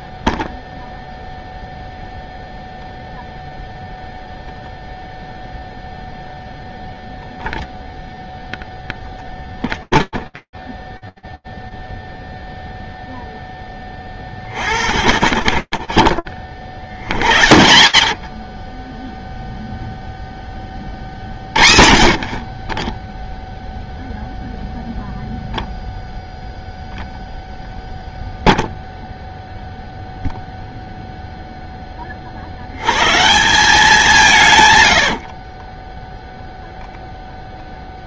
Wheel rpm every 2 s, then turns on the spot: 0, 0, 0, 0, 0, 0, 0, 50, 90, 0, 70, 10, 0, 0, 0, 0, 60, 140, 0.
none